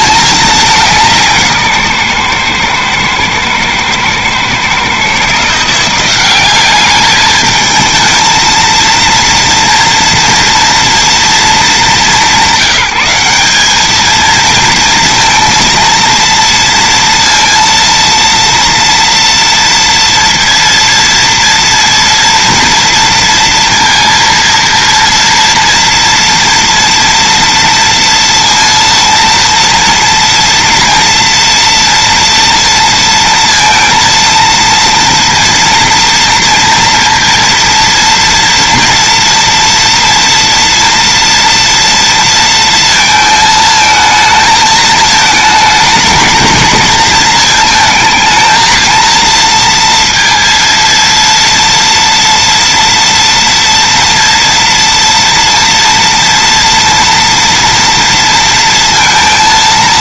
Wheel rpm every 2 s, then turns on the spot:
180, 110, 140, 210, 230, 230, 190, 230, 230, 230, 230, 230, 230, 230, 230, 230, 230, 230, 230, 230, 230, 230, 220, 220, 230, 230, 230, 230, 240, 230.
none